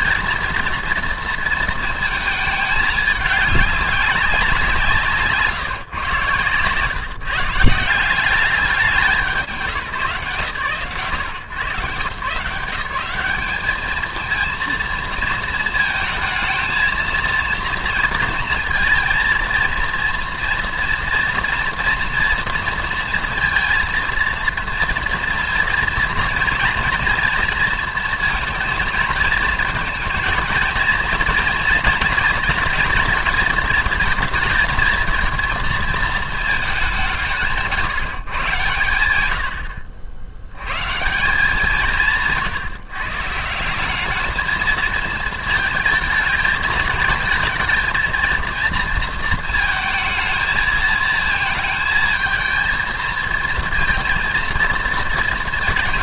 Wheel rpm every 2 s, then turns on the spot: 230, 210, 180, 120, 190, 130, 170, 230, 230, 230, 230, 230, 230, 230, 230, 220, 230, 220, 210, 120, 100, 150, 220, 220, 230, 220, 230, 230.
none